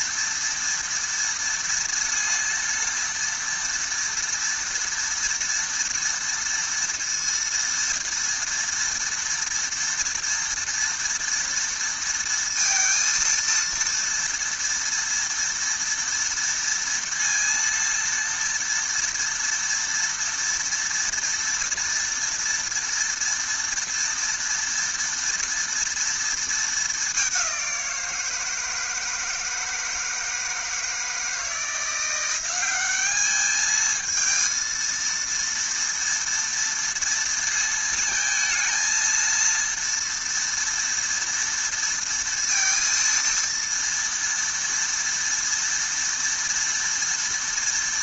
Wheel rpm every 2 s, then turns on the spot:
230, 230, 230, 230, 230, 230, 230, 230, 230, 230, 230, 230, 230, 200, 160, 160, 200, 230, 230, 230, 230, 230, 230, 230.
none